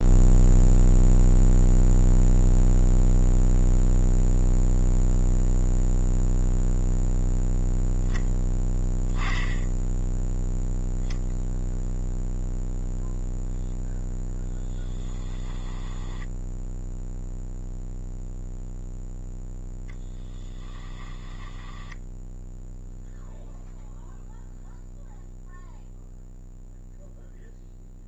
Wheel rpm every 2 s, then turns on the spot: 0, 0, 0, 0, 0, 0, 0, 20, 0, 0, 10, 0, 0, 0.
14-16 20-22